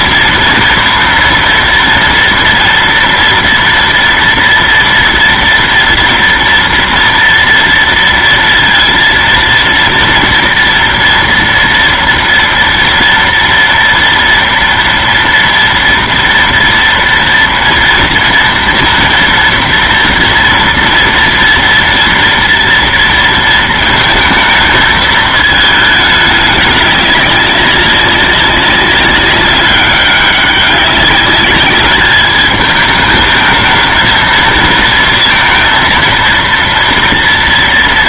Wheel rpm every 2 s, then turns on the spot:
230, 230, 230, 230, 230, 230, 230, 230, 230, 230, 230, 230, 220, 200, 200, 190, 210, 220, 230.
none